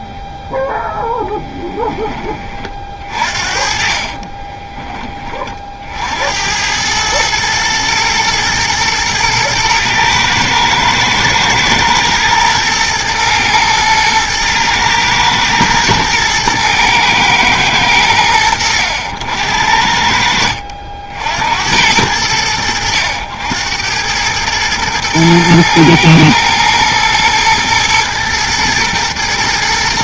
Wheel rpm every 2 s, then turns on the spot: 0, 30, 20, 80, 110, 110, 110, 110, 110, 90, 60, 90, 110, 110, 110.
4-6